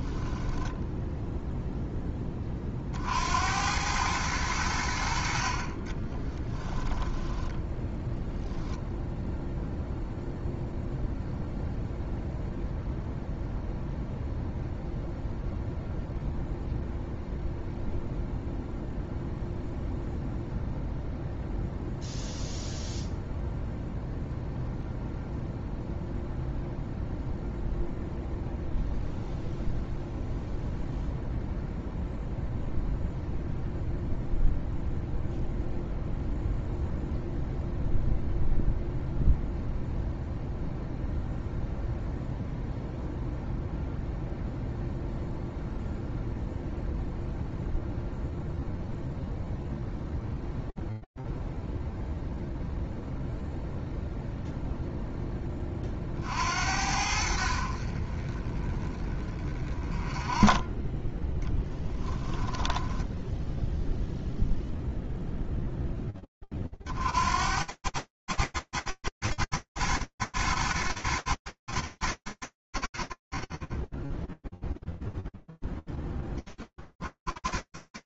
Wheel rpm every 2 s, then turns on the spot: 10, 30, 90, 10, 0, 0, 0, 0, 0, 0, 0, 0, 0, 0, 0, 0, 0, 0, 0, 0, 0, 0, 0, 0, 0, 0, 0, 0, 70, 20, 20, 10, 0, 90, 30, 10, 0, 10, 10.
0-2 6-8 62-64 74-78